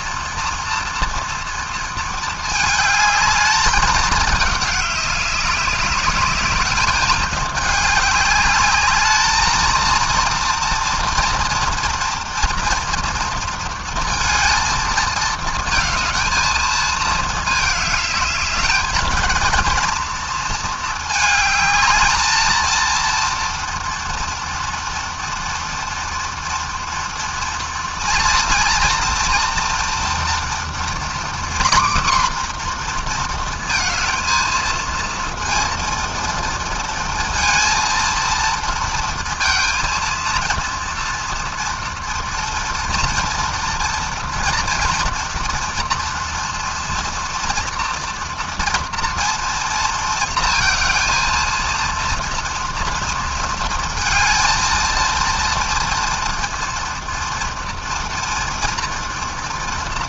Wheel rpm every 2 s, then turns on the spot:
230, 220, 200, 210, 210, 230, 230, 220, 220, 220, 220, 230, 240, 230, 230, 250, 230, 230, 230, 230, 230, 230, 230, 240, 230, 230, 230, 230, 230, 230.
none